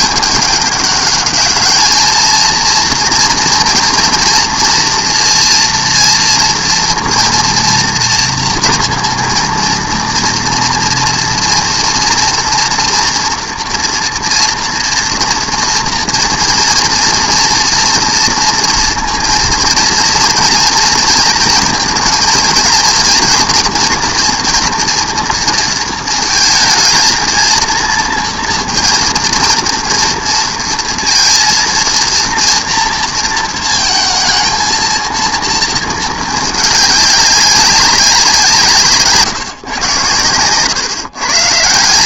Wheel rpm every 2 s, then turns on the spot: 200, 230, 240, 230, 230, 240, 230, 230, 230, 230, 230, 230, 230, 230, 230, 230, 230, 230, 210, 170, 120.
none